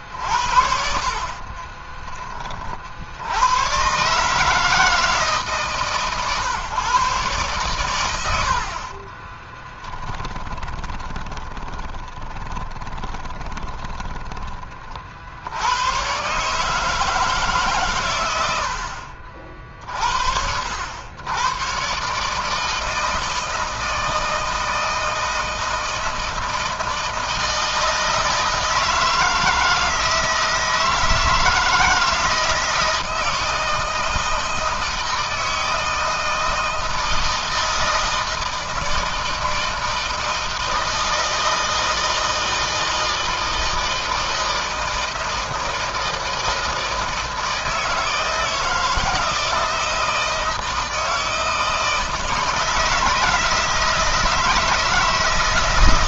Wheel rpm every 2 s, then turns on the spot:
50, 40, 160, 130, 50, 20, 20, 30, 150, 80, 80, 160, 160, 160, 160, 160, 160, 160, 160, 160, 160, 160, 160, 160, 160, 160, 160, 160.
0-2 8-14